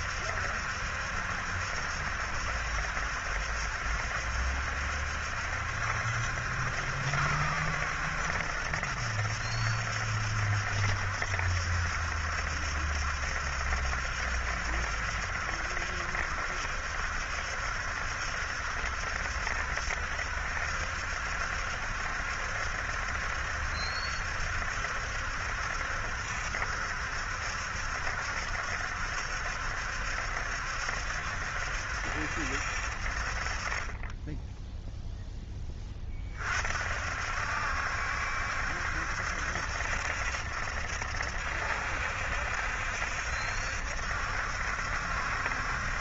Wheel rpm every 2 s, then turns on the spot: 70, 70, 70, 70, 70, 70, 70, 70, 70, 70, 70, 70, 70, 70, 70, 70, 60, 10, 50, 70, 70, 70, 70.
none